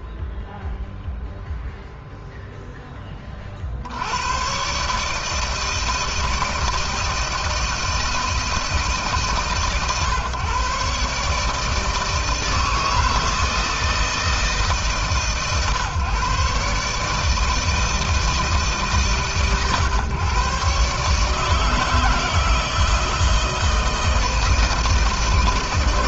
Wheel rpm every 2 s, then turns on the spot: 0, 10, 140, 160, 150, 140, 160, 150, 140, 150, 140, 170, 160.
none